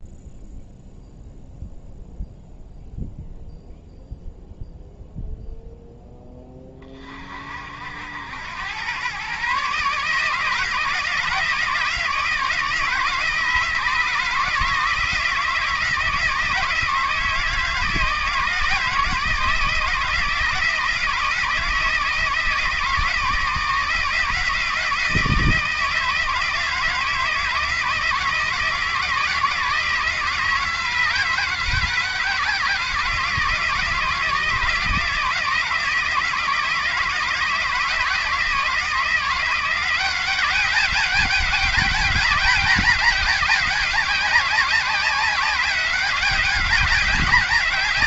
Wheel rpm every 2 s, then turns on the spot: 0, 0, 0, 20, 100, 160, 160, 160, 160, 160, 160, 160, 160, 160, 160, 160, 160, 160, 160, 160, 190, 200, 180, 200.
none